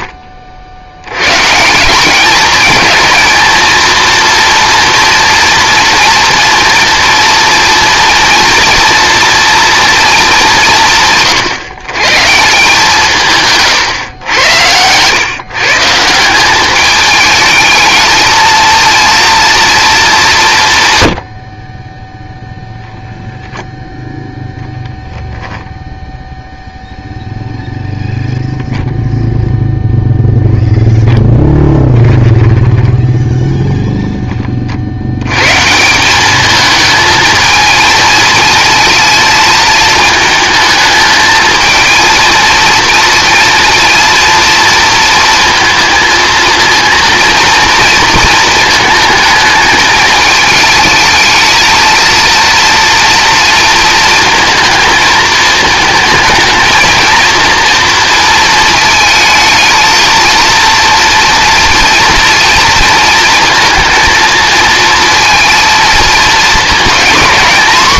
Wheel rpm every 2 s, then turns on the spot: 20, 200, 230, 230, 230, 210, 150, 110, 180, 220, 190, 0, 0, 0, 0, 0, 10, 60, 220, 230, 220, 230, 230, 230, 220, 220, 230, 220, 230, 220, 230, 230, 230, 230.
32-34